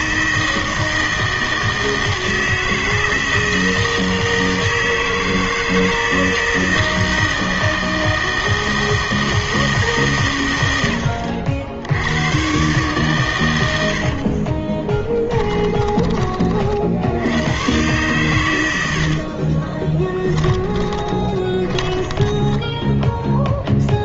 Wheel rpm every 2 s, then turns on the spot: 160, 160, 160, 160, 160, 100, 130, 30, 40, 90, 10, 10.
14-16 20-24